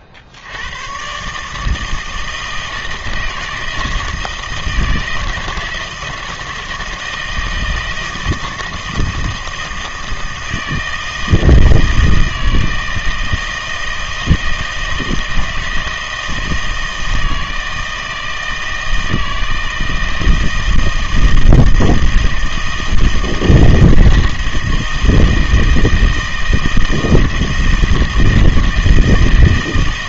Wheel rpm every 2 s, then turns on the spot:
60, 160, 160, 160, 160, 160, 160, 160, 160, 160, 160, 160, 160, 160, 160.
none